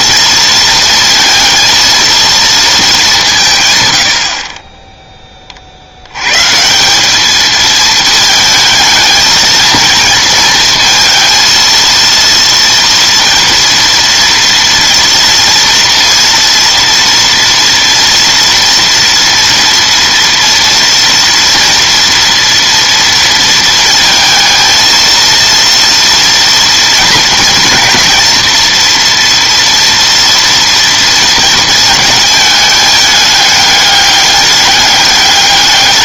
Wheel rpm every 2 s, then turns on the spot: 230, 210, 20, 170, 220, 230, 230, 240, 230, 230, 230, 230, 230, 240, 240, 230, 210, 200.
none